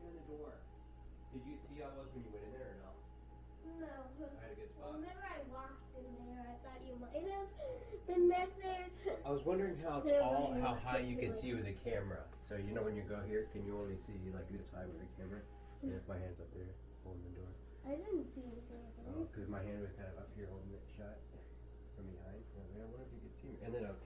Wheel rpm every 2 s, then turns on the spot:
0, 0, 0, 0, 0, 0, 0, 0, 0, 0, 0, 0.
none